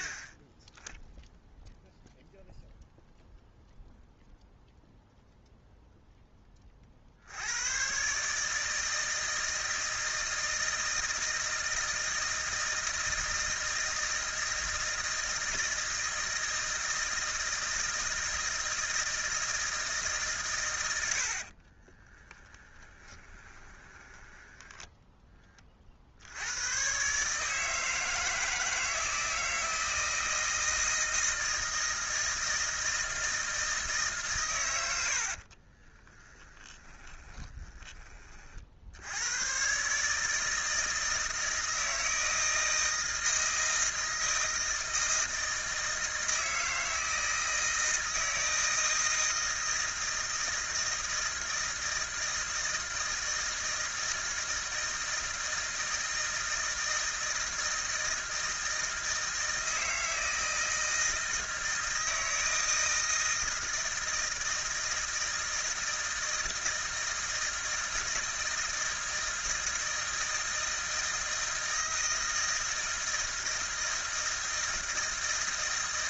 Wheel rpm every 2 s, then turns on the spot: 10, 0, 0, 30, 160, 160, 160, 160, 160, 160, 90, 20, 10, 130, 160, 160, 160, 80, 20, 80, 160, 160, 160, 160, 160, 160, 160, 160, 160, 160, 160, 160, 160, 160, 160, 160, 160, 160.
22-24 36-38